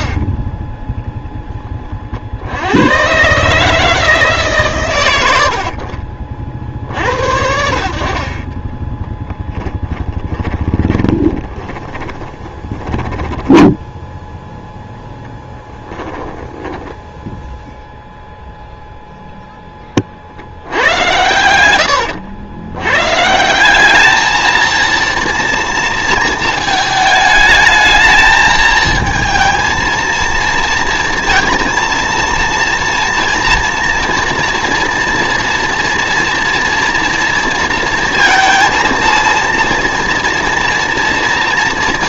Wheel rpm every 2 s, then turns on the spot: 20, 90, 130, 60, 20, 20, 20, 0, 20, 0, 90, 100, 220, 220, 220, 230, 230, 230, 230, 230, 240.
10-14 16-18